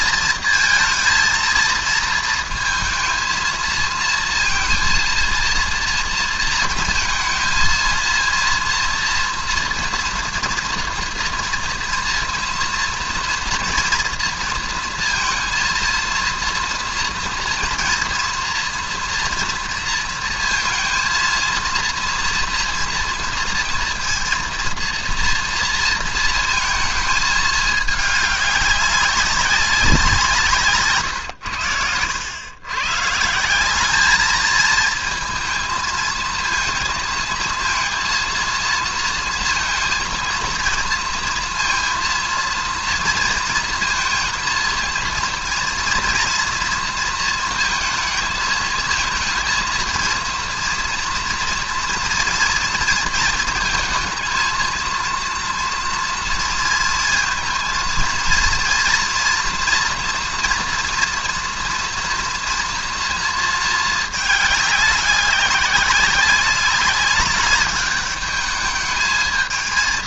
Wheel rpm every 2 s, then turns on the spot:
230, 230, 230, 230, 230, 230, 240, 230, 230, 240, 230, 230, 230, 230, 200, 150, 120, 220, 230, 230, 230, 230, 230, 230, 220, 230, 230, 230, 230, 230, 240, 240, 210, 200, 210.
none